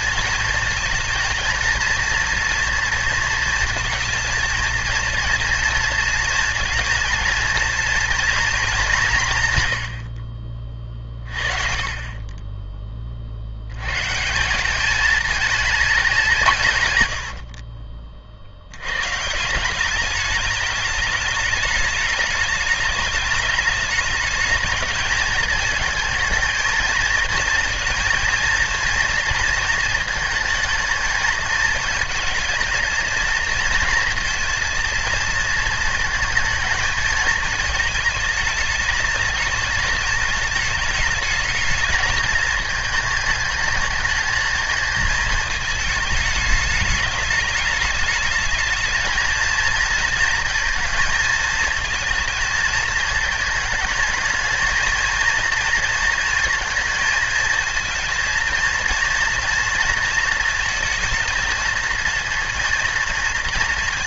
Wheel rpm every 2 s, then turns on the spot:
230, 230, 230, 230, 210, 40, 20, 200, 120, 80, 210, 210, 220, 220, 230, 220, 230, 230, 220, 220, 220, 220, 220, 220, 220, 230, 220, 220, 220, 230, 230, 230.
none